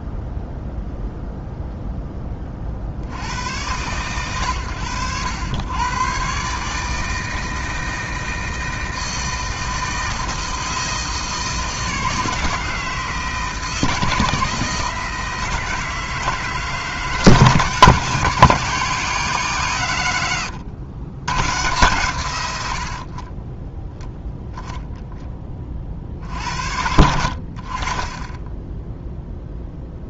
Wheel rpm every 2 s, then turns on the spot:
0, 70, 100, 160, 160, 160, 160, 160, 160, 180, 120, 50, 20, 70, 0.
none